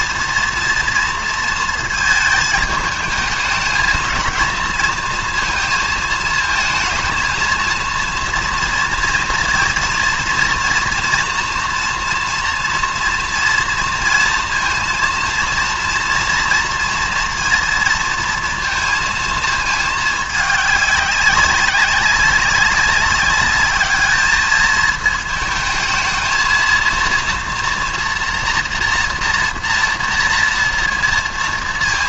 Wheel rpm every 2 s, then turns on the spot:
230, 220, 230, 220, 230, 230, 240, 230, 240, 230, 200, 200, 220, 230, 240, 230.
none